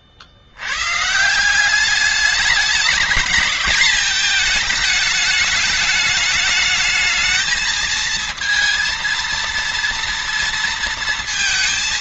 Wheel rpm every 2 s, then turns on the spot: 80, 210, 220, 210, 230, 230.
none